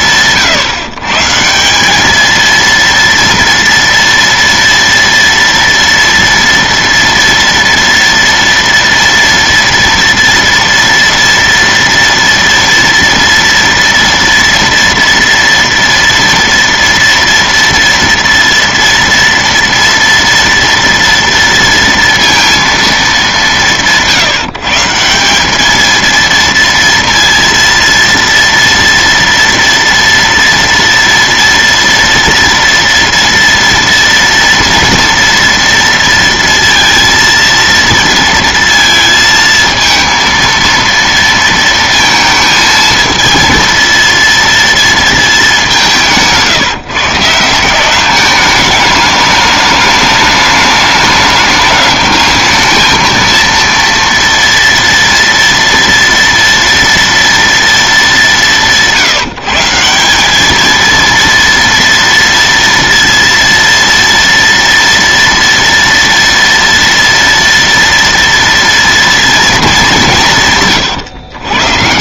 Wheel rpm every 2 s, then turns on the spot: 130, 230, 230, 230, 230, 230, 230, 230, 230, 230, 230, 230, 160, 230, 230, 230, 230, 230, 230, 230, 230, 220, 230, 150, 210, 210, 220, 230, 230, 180, 220, 230, 230, 230, 240, 130.
70-72